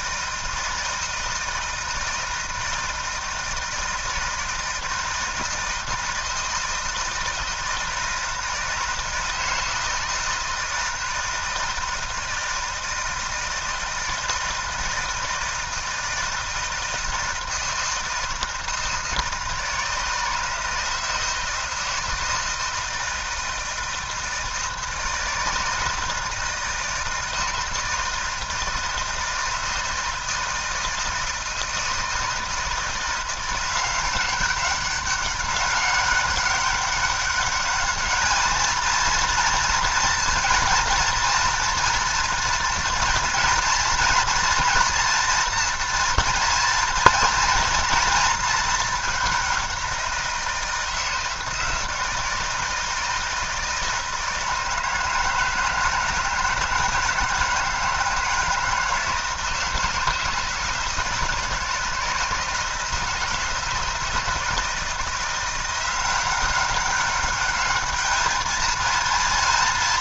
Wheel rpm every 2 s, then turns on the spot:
160, 160, 160, 160, 160, 160, 160, 160, 160, 160, 160, 160, 160, 160, 160, 160, 160, 190, 200, 220, 230, 230, 230, 240, 220, 170, 160, 160, 160, 160, 160, 160, 160, 190, 220.
none